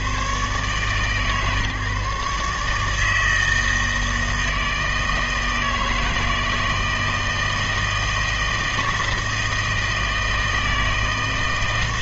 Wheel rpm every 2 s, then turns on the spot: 130, 150, 160, 160, 160, 160.
none